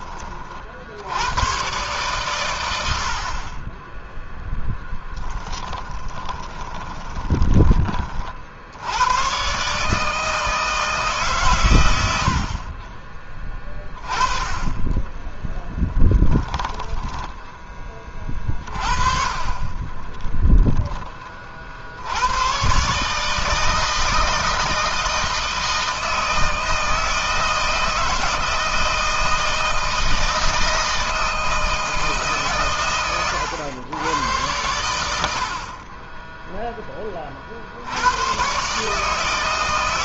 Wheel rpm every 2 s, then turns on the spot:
70, 80, 10, 20, 100, 150, 30, 20, 20, 30, 20, 140, 160, 160, 160, 160, 120, 90, 20, 150.
4-8 16-18